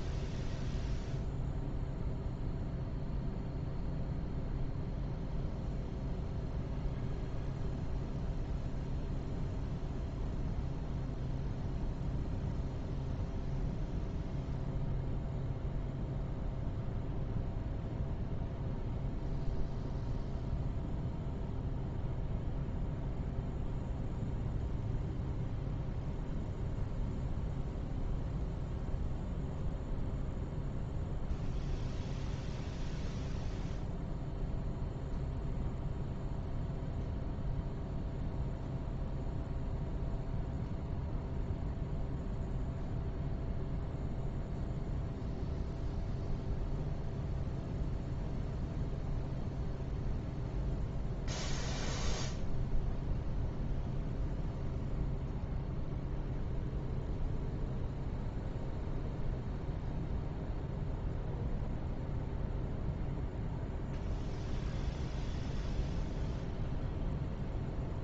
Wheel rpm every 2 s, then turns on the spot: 0, 0, 0, 0, 0, 0, 0, 0, 0, 0, 0, 0, 0, 0, 0, 0, 0, 0, 0, 0, 0, 0, 0, 0, 0, 0, 0, 0, 0, 0, 0, 0, 0, 0.
none